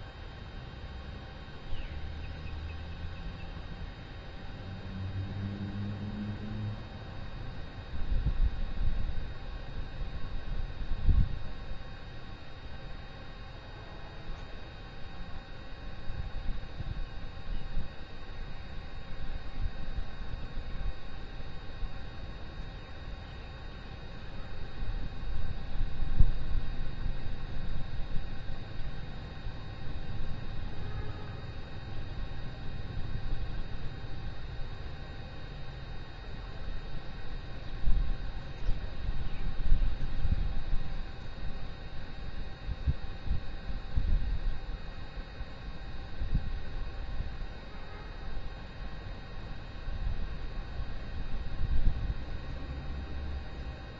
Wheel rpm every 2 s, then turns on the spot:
0, 0, 0, 0, 0, 0, 0, 0, 0, 0, 0, 0, 0, 0, 0, 0, 0, 0, 0, 0, 0, 0, 0, 0, 0, 0, 0.
none